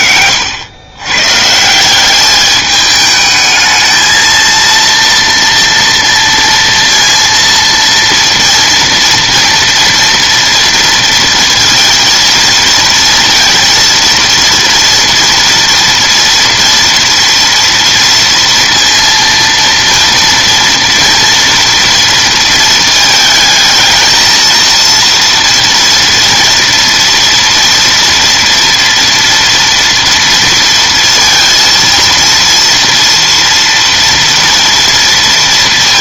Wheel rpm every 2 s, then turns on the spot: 100, 210, 230, 230, 230, 230, 230, 230, 240, 230, 230, 220, 230, 230, 230, 230, 230, 230.
none